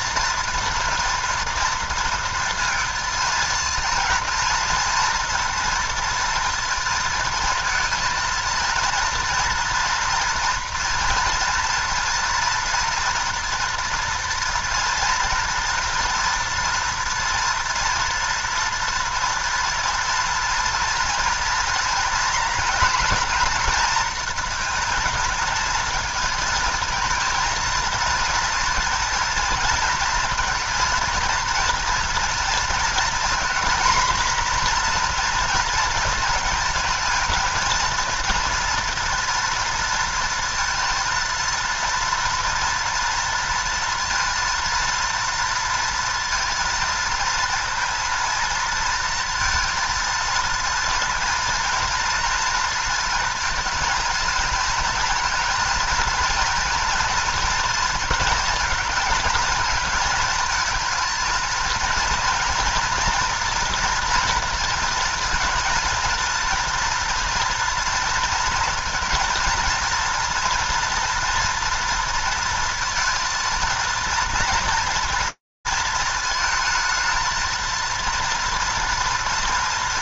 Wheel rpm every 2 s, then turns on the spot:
230, 230, 230, 230, 230, 230, 230, 230, 230, 230, 230, 230, 220, 220, 230, 230, 230, 240, 230, 240, 230, 240, 230, 230, 230, 230, 230, 220, 230, 230, 220, 230, 230, 230, 230, 230, 230, 230, 220, 230.
none